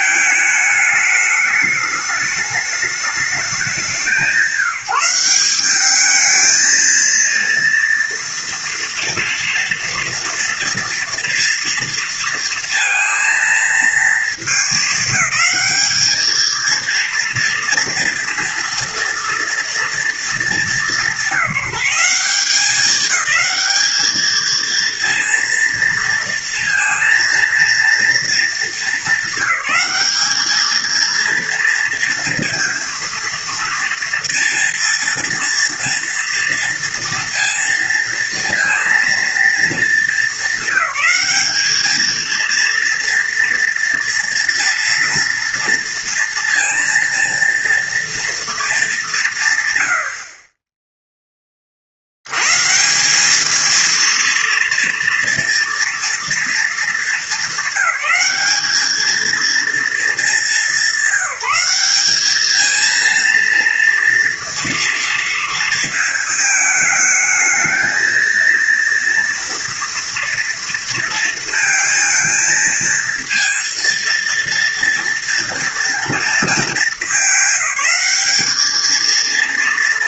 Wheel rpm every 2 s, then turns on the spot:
210, 210, 170, 220, 230, 230, 230, 220, 230, 230, 210, 200, 230, 230, 230, 220, 240, 230, 230, 230, 220, 230, 230, 230, 220, 30, 140, 230, 220, 210, 200, 220, 230, 220, 230, 230, 230, 230, 220, 220.
none